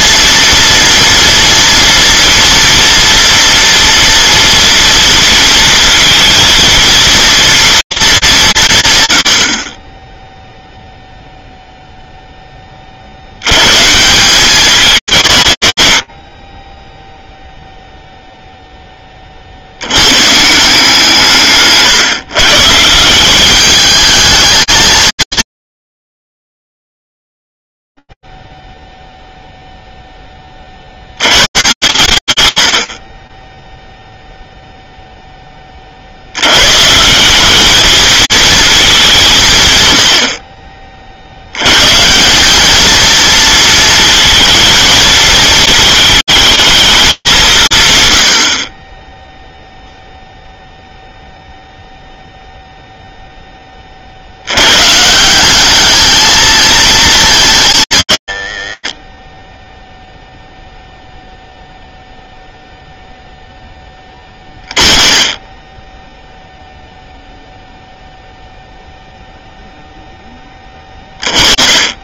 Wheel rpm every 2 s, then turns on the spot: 230, 230, 230, 230, 160, 0, 30, 170, 10, 20, 160, 170, 220, 10, 0, 40, 110, 0, 110, 210, 40, 220, 230, 210, 30, 0, 10, 200, 210, 50, 0, 10, 20, 0, 10, 30.
none